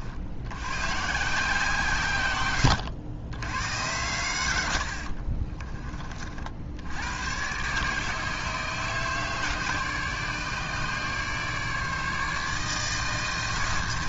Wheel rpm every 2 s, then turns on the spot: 130, 100, 80, 80, 160, 150, 160.
4-6